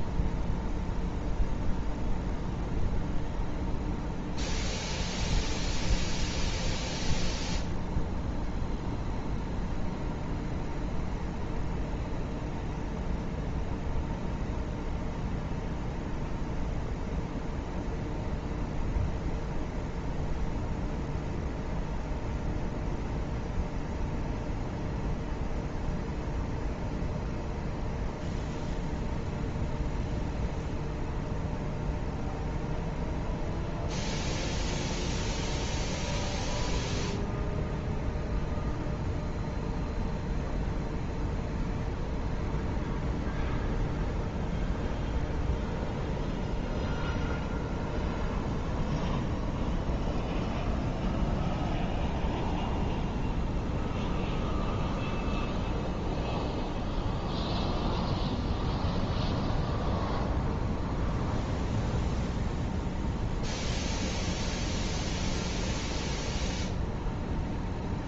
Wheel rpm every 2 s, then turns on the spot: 0, 0, 0, 0, 0, 0, 0, 0, 0, 0, 0, 0, 0, 0, 0, 0, 0, 0, 0, 0, 0, 0, 0, 0, 0, 0, 0, 0, 0, 0, 0, 0, 0, 0.
none